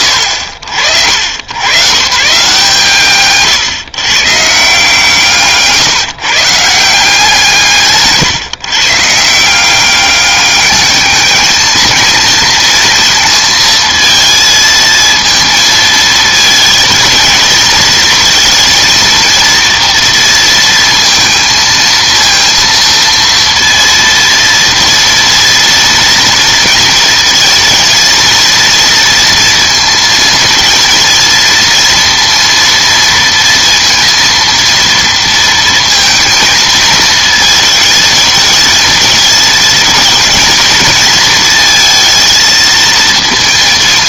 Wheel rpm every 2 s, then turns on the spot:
80, 150, 160, 170, 150, 210, 230, 230, 230, 230, 230, 230, 230, 230, 230, 230, 230, 230, 230, 220, 230, 230.
none